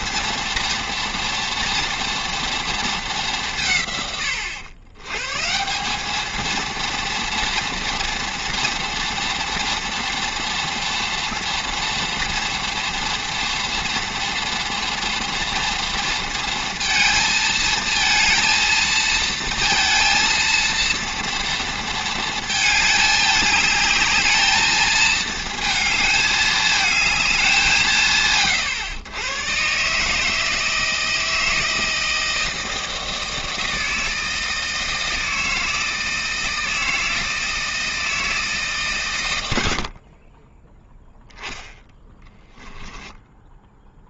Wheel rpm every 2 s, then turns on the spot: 230, 220, 110, 230, 230, 230, 230, 230, 230, 230, 230, 220, 220, 220, 120, 160, 160, 160, 160, 140, 10, 10.
42-44